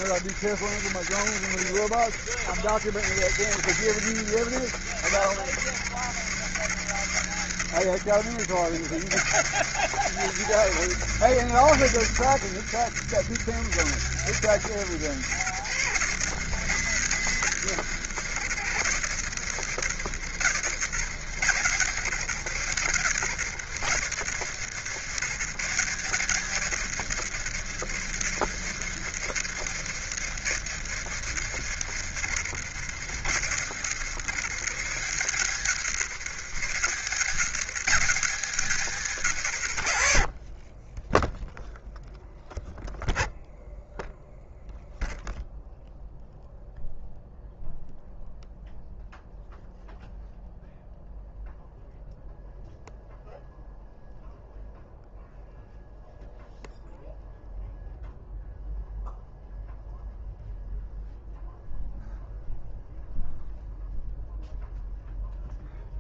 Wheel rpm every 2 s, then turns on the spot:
80, 80, 80, 70, 70, 90, 80, 80, 100, 80, 80, 80, 80, 90, 80, 80, 70, 80, 80, 100, 30, 0, 0, 0, 0, 0, 0, 0, 0, 0, 0, 0, 0.
none